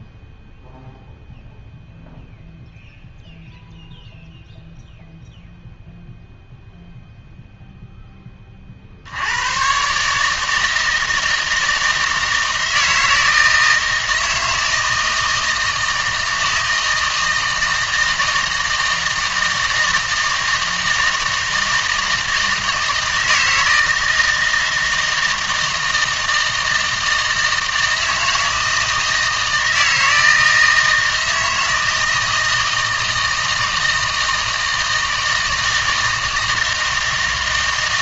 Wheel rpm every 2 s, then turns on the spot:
0, 0, 0, 0, 40, 160, 160, 160, 160, 160, 160, 160, 160, 160, 160, 160, 160, 160, 160.
none